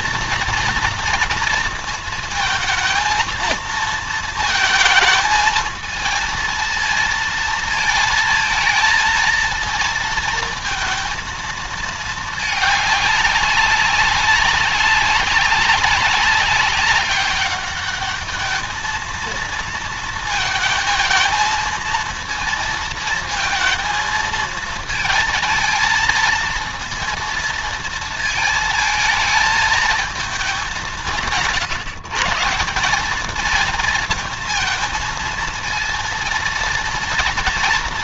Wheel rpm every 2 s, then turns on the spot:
230, 230, 230, 230, 230, 230, 210, 200, 200, 220, 220, 230, 230, 230, 220, 200, 190, 230, 230.
none